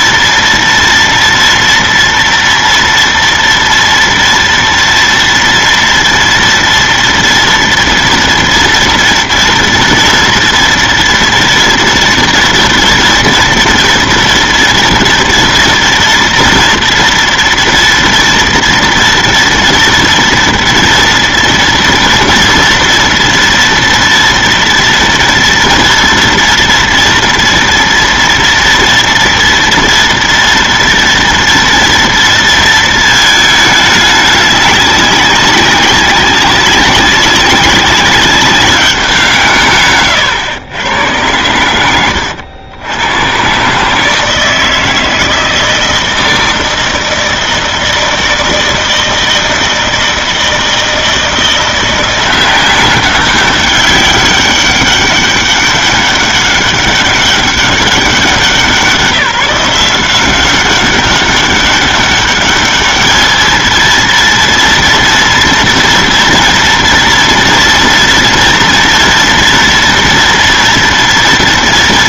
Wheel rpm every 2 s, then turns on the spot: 230, 230, 230, 230, 230, 230, 230, 240, 230, 230, 230, 230, 230, 230, 230, 230, 230, 200, 190, 200, 110, 100, 160, 160, 160, 160, 180, 200, 200, 190, 190, 200, 230, 230, 230, 240.
none